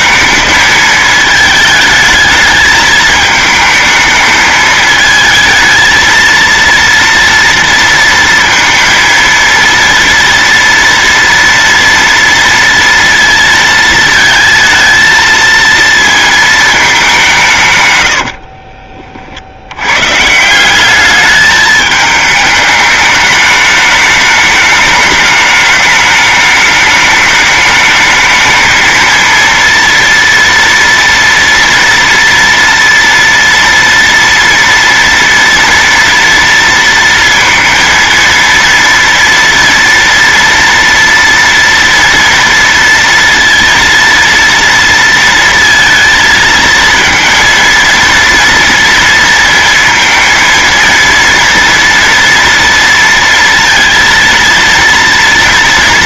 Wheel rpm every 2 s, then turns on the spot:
220, 220, 220, 230, 230, 240, 230, 220, 220, 50, 170, 210, 210, 210, 220, 230, 230, 240, 230, 230, 230, 230, 230, 230, 230, 230, 230, 230.
18-20